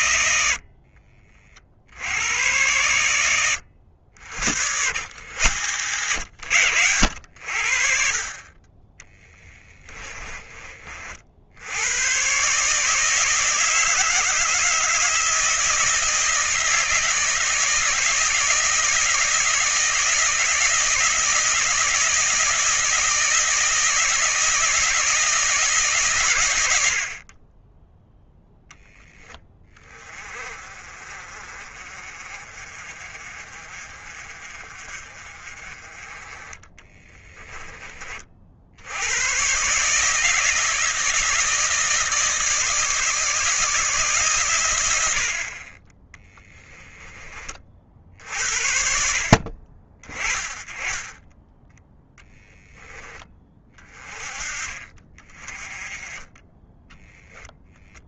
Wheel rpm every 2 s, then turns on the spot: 50, 100, 100, 90, 20, 40, 150, 160, 160, 160, 160, 160, 160, 60, 10, 40, 40, 40, 20, 80, 160, 150, 80, 20, 50, 20, 10, 40, 10.
0-2 36-38 46-48